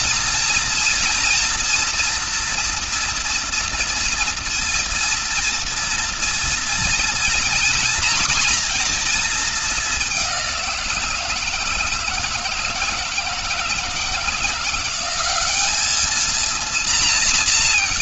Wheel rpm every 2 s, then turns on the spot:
230, 230, 230, 230, 230, 170, 160, 180, 230.
none